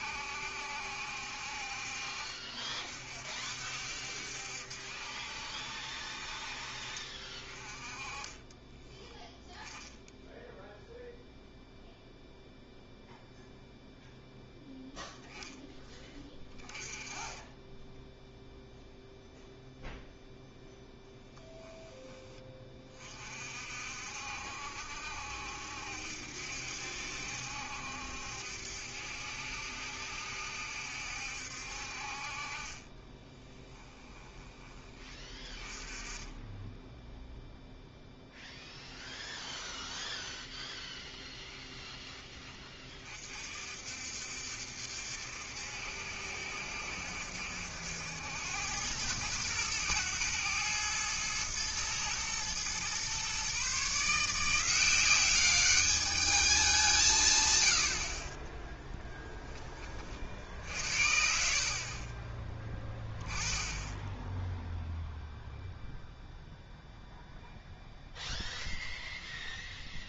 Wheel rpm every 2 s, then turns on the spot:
70, 50, 70, 50, 20, 0, 0, 0, 20, 0, 0, 30, 70, 70, 70, 70, 30, 20, 10, 10, 10, 30, 70, 70, 90, 110, 120, 170, 180, 10, 60, 10, 0, 0, 0.
6-10 38-42 58-60